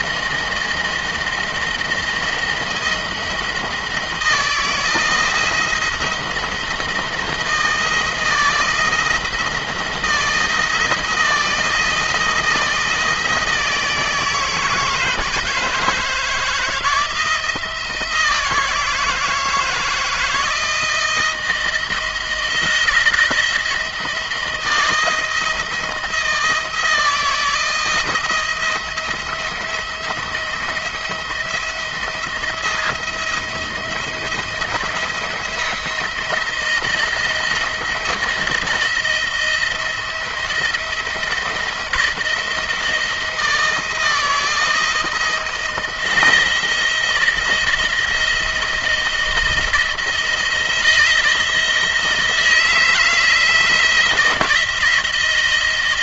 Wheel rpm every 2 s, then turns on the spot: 170, 170, 160, 170, 160, 170, 170, 160, 160, 160, 160, 170, 160, 160, 170, 170, 170, 170, 170, 170, 170, 170, 170, 160, 170, 170, 160, 170.
none